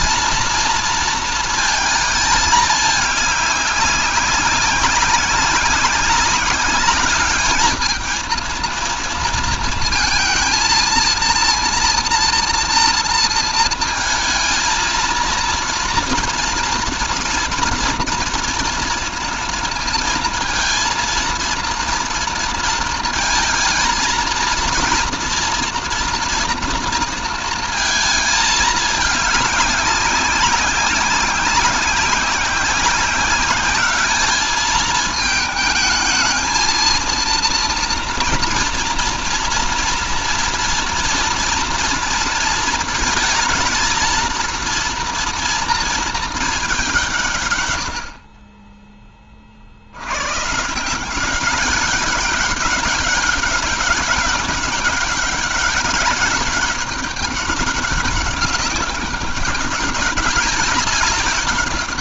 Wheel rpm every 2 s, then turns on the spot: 230, 210, 190, 200, 230, 230, 230, 230, 230, 230, 230, 230, 230, 230, 220, 190, 190, 210, 220, 230, 230, 230, 230, 200, 30, 160, 190, 200, 200, 190, 200.
none